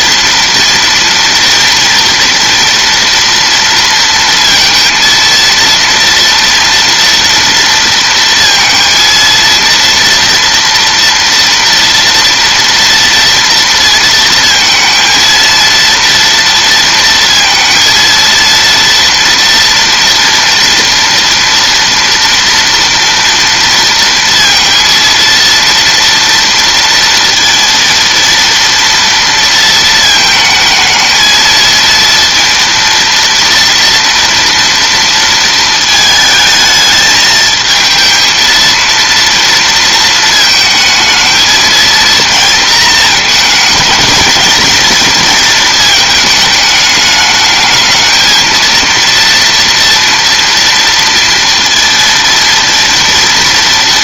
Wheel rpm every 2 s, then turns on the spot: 230, 230, 230, 240, 230, 230, 230, 230, 230, 230, 230, 230, 230, 230, 230, 220, 230, 230, 220, 230, 220, 230, 230, 220, 230, 230, 230.
none